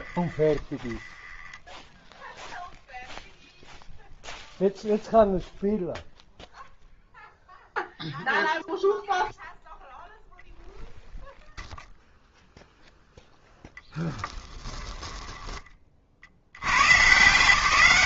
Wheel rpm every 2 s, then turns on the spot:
20, 0, 0, 0, 0, 0, 0, 10, 110.
0-2 14-16